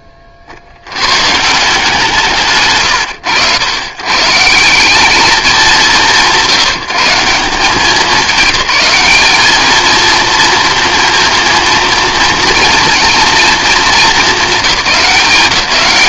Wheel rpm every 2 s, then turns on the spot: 80, 110, 170, 150, 200, 230, 230, 200.
2-4